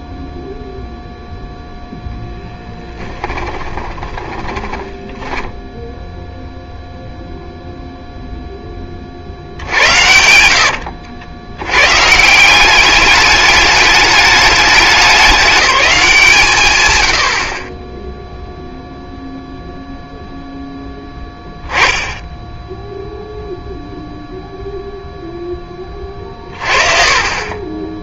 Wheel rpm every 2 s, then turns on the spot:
0, 10, 20, 0, 10, 90, 180, 200, 160, 0, 0, 10, 0, 40.
4-6